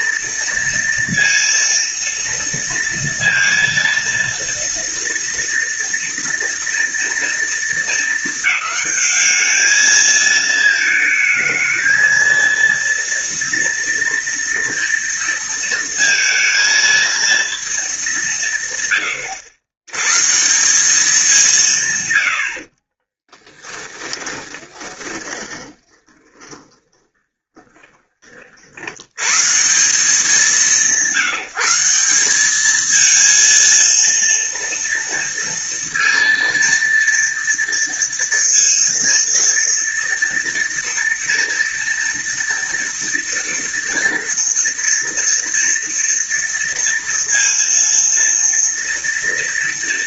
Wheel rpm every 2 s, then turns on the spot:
230, 230, 230, 230, 210, 220, 230, 230, 230, 110, 180, 40, 20, 20, 80, 170, 220, 230, 230, 230, 230, 230, 230, 230, 230.
22-28